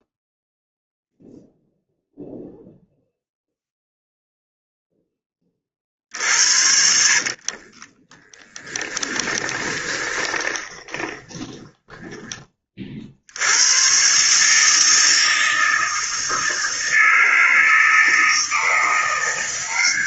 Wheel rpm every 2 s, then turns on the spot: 0, 0, 0, 70, 20, 20, 20, 140, 160, 160.
6-12